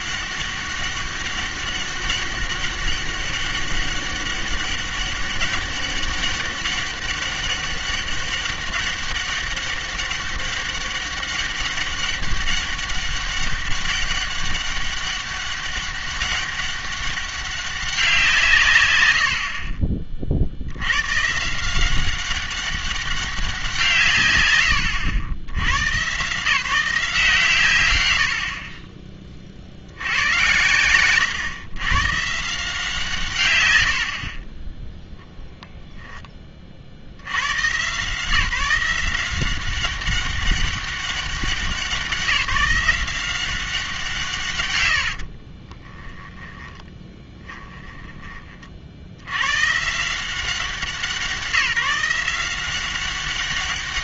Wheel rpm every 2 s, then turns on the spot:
200, 200, 200, 200, 200, 200, 200, 200, 200, 130, 70, 200, 110, 160, 40, 100, 160, 30, 50, 170, 200, 170, 120, 10, 40, 190, 180.
30-32 46-48